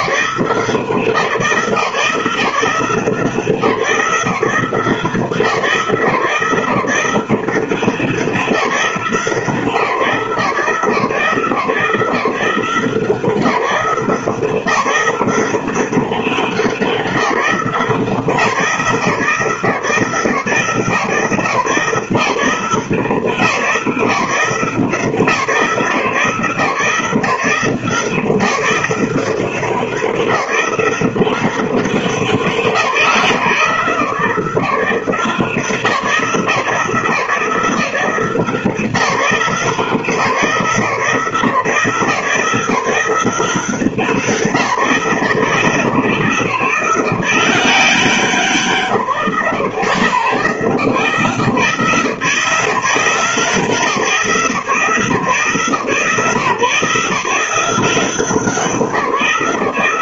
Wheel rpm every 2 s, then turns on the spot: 170, 170, 170, 180, 170, 140, 170, 180, 170, 170, 150, 150, 150, 170, 180, 180, 170, 160, 160, 180, 170, 170, 160, 160, 170, 160, 170, 160, 150, 180.
none